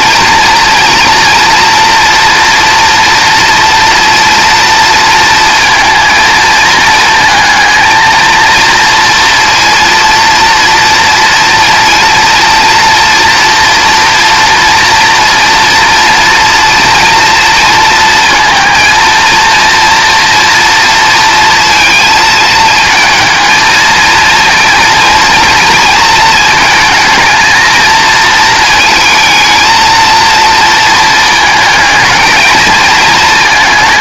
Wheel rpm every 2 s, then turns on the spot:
230, 230, 230, 220, 230, 230, 230, 230, 230, 230, 230, 220, 230, 230, 220, 220, 220.
none